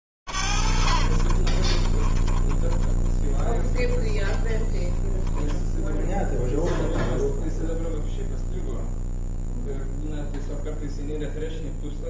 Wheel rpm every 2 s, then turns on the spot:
20, 40, 10, 0, 0, 0.
none